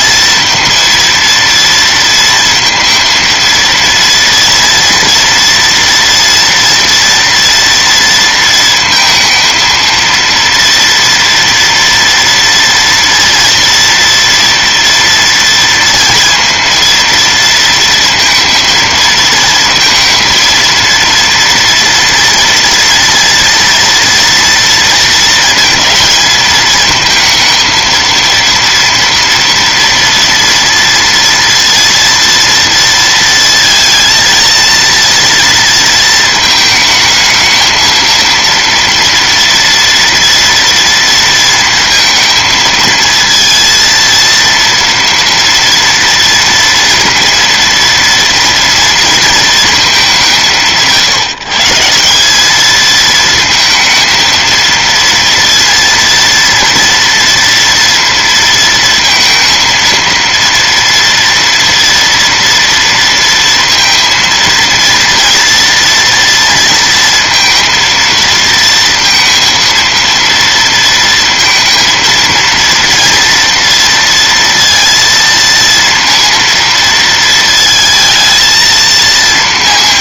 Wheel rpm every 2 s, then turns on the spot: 230, 230, 230, 240, 230, 230, 230, 230, 230, 230, 230, 230, 230, 220, 230, 230, 230, 230, 220, 230, 240, 230, 230, 230, 230, 160, 220, 230, 230, 230, 230, 230, 230, 230, 230, 230, 230, 230, 230, 230.
none